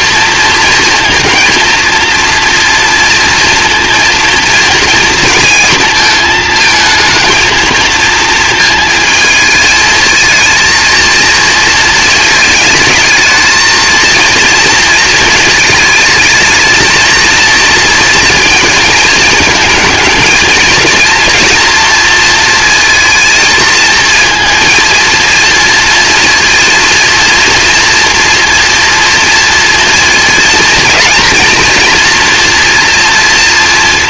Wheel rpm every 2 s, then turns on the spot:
230, 230, 230, 220, 230, 230, 220, 230, 220, 230, 220, 230, 230, 230, 230, 230, 240.
none